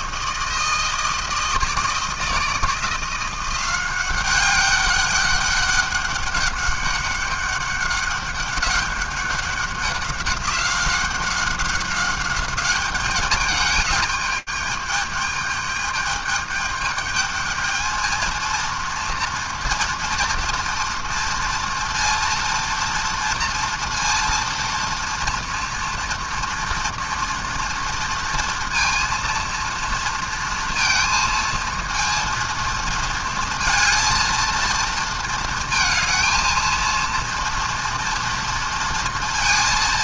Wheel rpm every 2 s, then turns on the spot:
160, 160, 190, 190, 200, 190, 200, 210, 210, 230, 230, 230, 230, 230, 230, 230, 230, 230, 230, 230.
none